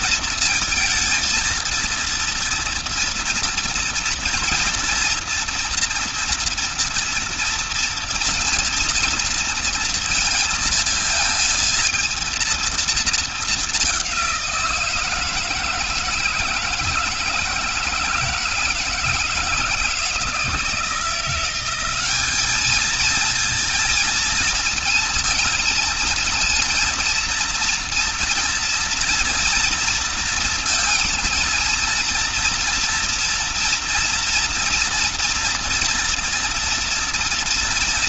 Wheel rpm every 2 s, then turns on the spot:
230, 230, 230, 230, 230, 230, 220, 160, 160, 160, 160, 220, 230, 230, 230, 230, 230, 240, 230.
none